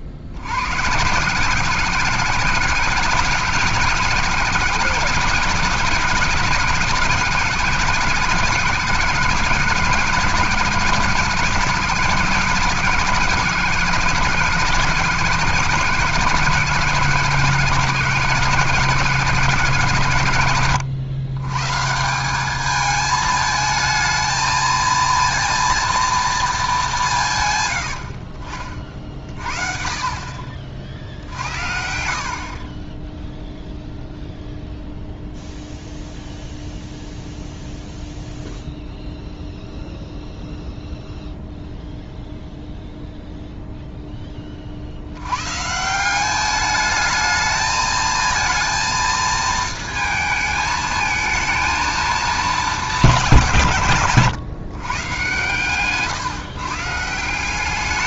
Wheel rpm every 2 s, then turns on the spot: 100, 180, 190, 180, 190, 180, 180, 180, 180, 180, 120, 200, 220, 220, 40, 30, 40, 0, 0, 0, 0, 0, 30, 200, 230, 220, 200, 130, 150.
none